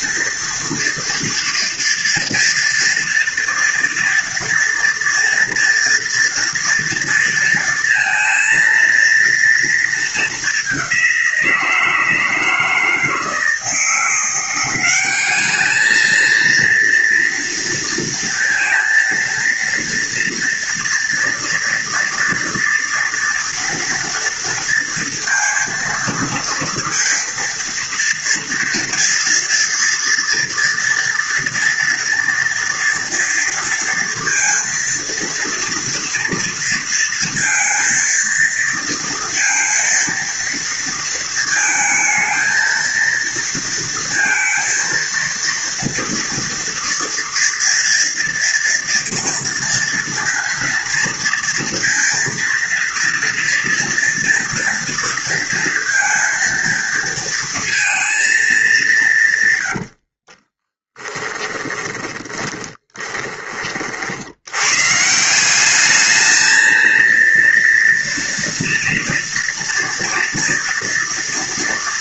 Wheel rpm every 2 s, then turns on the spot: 230, 230, 230, 230, 230, 200, 160, 180, 230, 230, 230, 230, 230, 230, 230, 230, 240, 230, 230, 230, 230, 230, 230, 230, 230, 230, 230, 230, 230, 220, 30, 20, 110, 220, 230, 230.
60-64